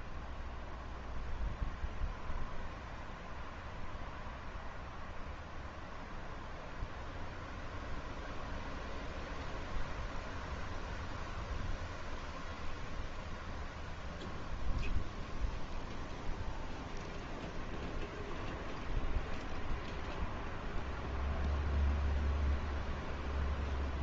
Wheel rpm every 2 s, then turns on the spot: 10, 0, 0, 0, 0, 0, 0, 0, 0, 0, 0, 0.
none